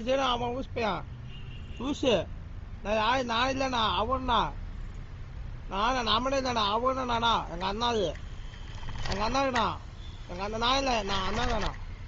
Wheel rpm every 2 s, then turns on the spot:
0, 0, 0, 0, 10, 10.
8-10